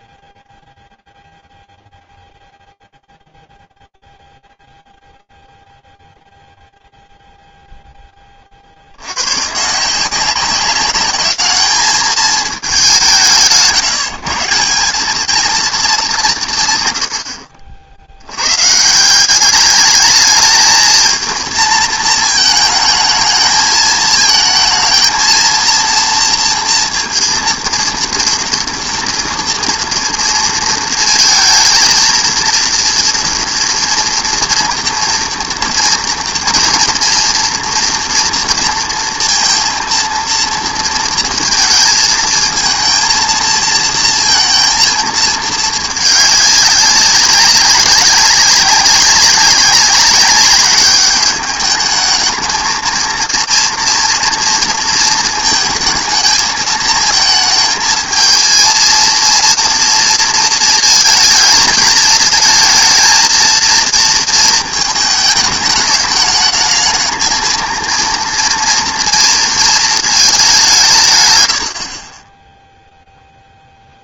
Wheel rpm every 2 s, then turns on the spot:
0, 0, 0, 0, 20, 180, 210, 150, 180, 100, 220, 220, 220, 230, 230, 230, 230, 230, 230, 230, 230, 220, 230, 200, 200, 200, 220, 230, 220, 220, 230, 220, 230, 210, 230, 200, 20.
none